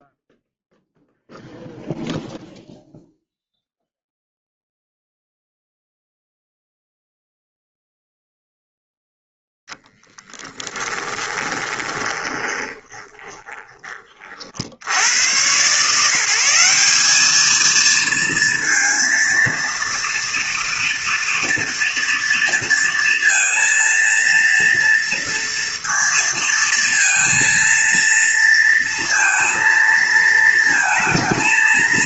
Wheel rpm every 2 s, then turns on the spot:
0, 0, 0, 0, 0, 10, 20, 90, 200, 230, 230, 230, 230, 230, 230, 220.
10-14